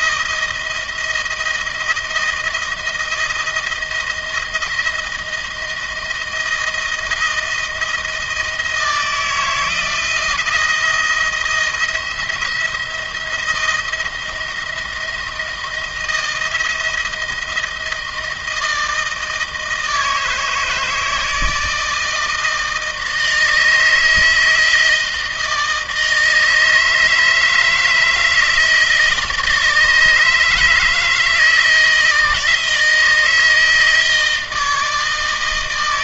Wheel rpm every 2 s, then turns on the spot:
170, 160, 160, 160, 160, 170, 170, 170, 160, 160, 160, 160, 160, 160, 160, 160, 160, 160.
none